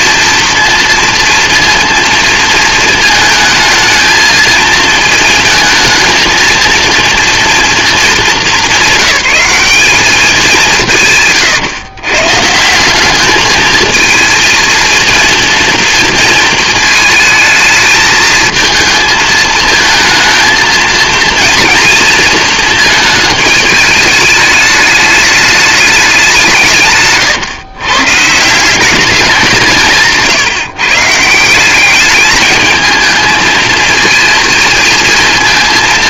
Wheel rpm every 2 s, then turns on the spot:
230, 230, 230, 230, 190, 170, 160, 230, 220, 220, 230, 220, 210, 160, 200, 140, 220, 230.
none